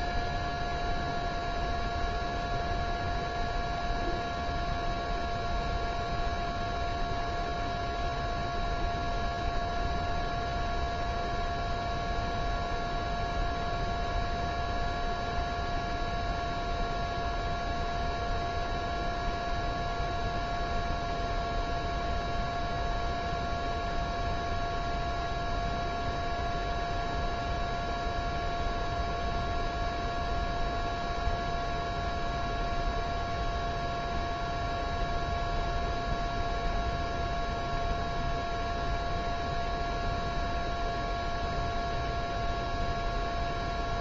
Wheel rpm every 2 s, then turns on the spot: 0, 0, 0, 0, 0, 0, 0, 0, 0, 0, 0, 0, 0, 0, 0, 0, 0, 0, 0, 0, 0, 0.
none